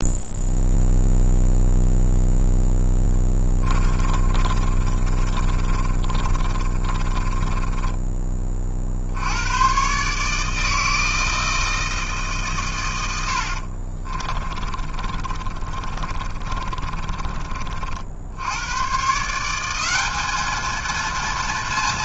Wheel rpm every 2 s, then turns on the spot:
0, 10, 30, 30, 40, 160, 130, 30, 40, 110, 220.
4-8 14-18